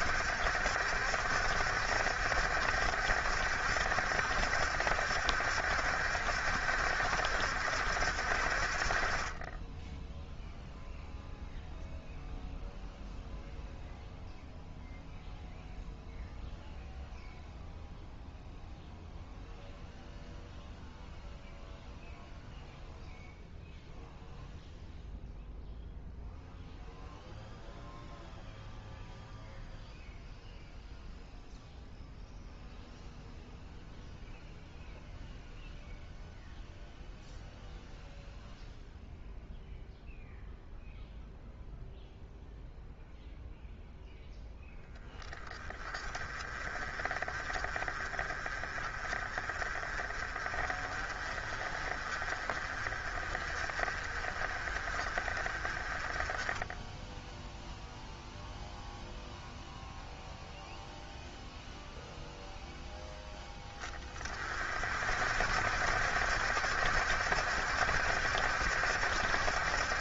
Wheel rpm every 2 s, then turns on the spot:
60, 70, 70, 70, 50, 0, 0, 0, 0, 0, 0, 0, 0, 0, 0, 0, 0, 0, 0, 0, 0, 0, 0, 30, 40, 40, 40, 40, 10, 0, 0, 0, 40, 70, 70.
none